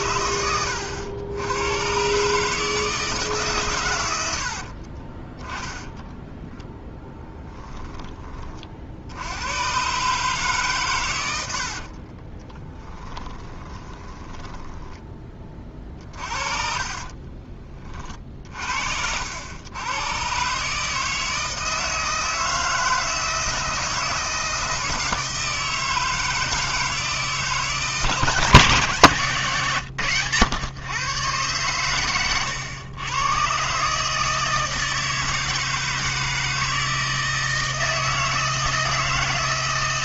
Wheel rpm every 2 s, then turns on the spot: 90, 150, 40, 10, 50, 120, 10, 10, 40, 70, 150, 160, 160, 160, 150, 130, 110, 160, 160, 160.
4-6 12-18